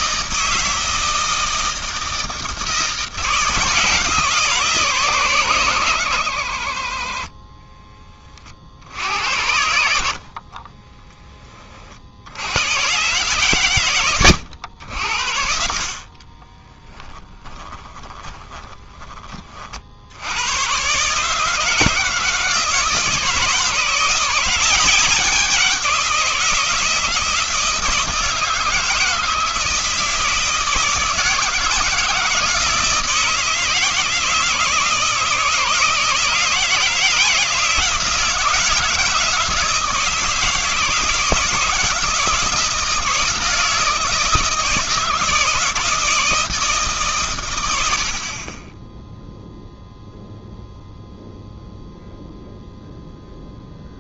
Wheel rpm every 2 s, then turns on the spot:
160, 160, 160, 70, 60, 30, 110, 90, 20, 20, 110, 160, 180, 170, 160, 160, 160, 160, 160, 160, 160, 170, 160, 160, 30, 0, 0.
10-12 16-20